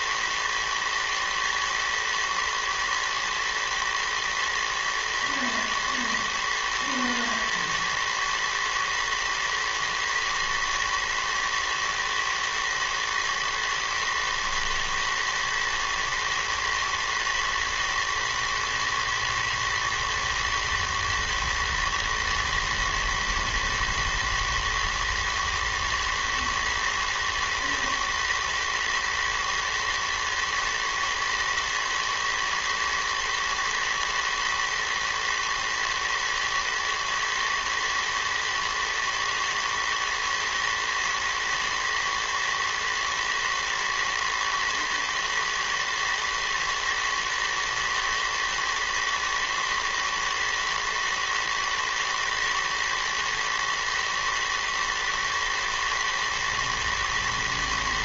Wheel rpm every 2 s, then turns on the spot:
120, 110, 110, 110, 120, 110, 110, 110, 120, 120, 120, 120, 110, 110, 110, 110, 110, 110, 110, 110, 110, 120, 110, 110, 110, 110, 120, 120, 110.
none